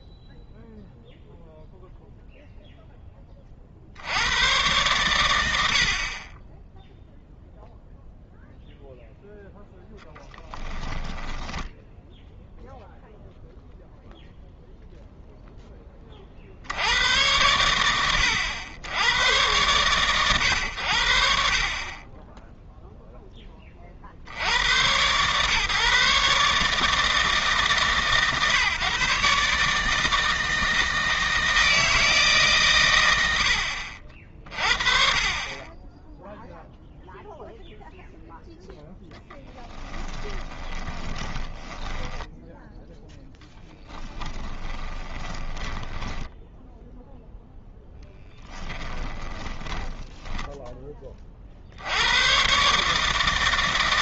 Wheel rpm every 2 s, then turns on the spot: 0, 0, 100, 0, 0, 10, 0, 0, 70, 80, 90, 0, 110, 150, 140, 160, 110, 20, 0, 10, 20, 10, 30, 0, 10, 10, 140.
10-12 40-42 44-46 48-50